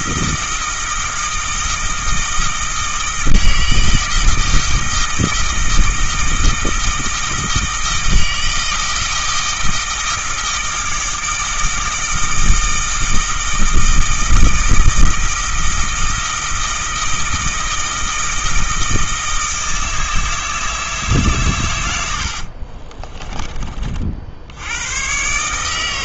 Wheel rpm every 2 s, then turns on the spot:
160, 160, 160, 160, 160, 160, 160, 160, 160, 160, 160, 40, 90.
22-24